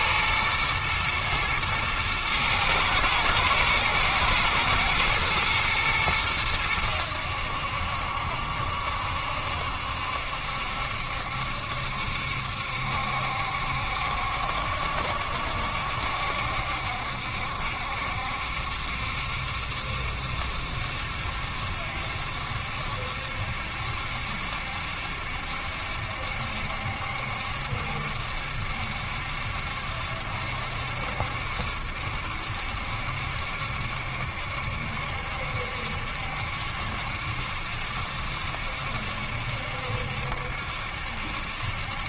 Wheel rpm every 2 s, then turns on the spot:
110, 110, 110, 100, 70, 70, 70, 70, 70, 70, 70, 70, 70, 70, 70, 70, 70, 70, 70, 70, 70.
none